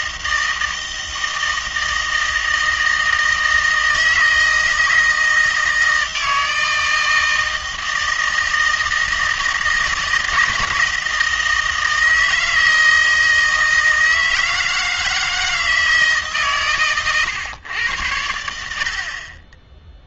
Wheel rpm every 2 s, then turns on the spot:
160, 160, 160, 160, 160, 160, 160, 160, 140, 70.
none